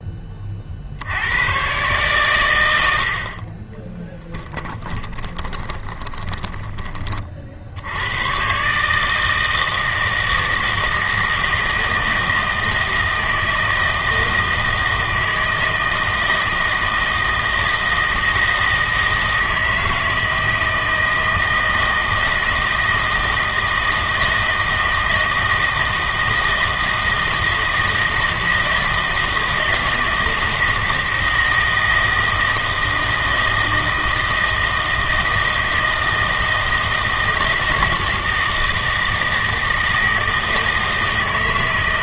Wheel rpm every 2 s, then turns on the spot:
40, 90, 20, 20, 140, 160, 160, 160, 160, 160, 160, 160, 160, 160, 160, 160, 160, 160, 160, 160, 160.
4-6